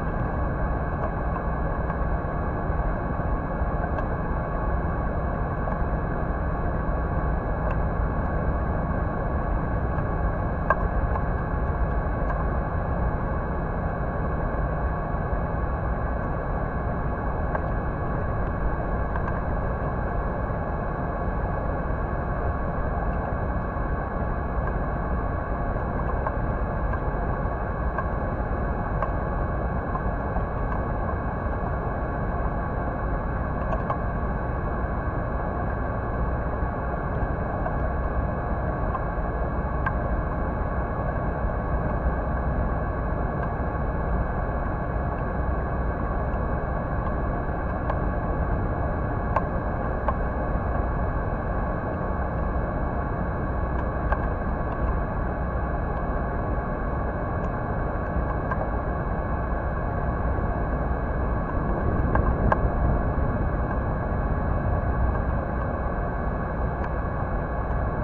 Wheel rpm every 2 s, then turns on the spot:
0, 0, 0, 0, 0, 0, 0, 0, 0, 0, 0, 0, 0, 0, 0, 0, 0, 0, 0, 0, 0, 0, 0, 0, 0, 0, 0, 0, 0, 0, 0, 0, 0, 0.
none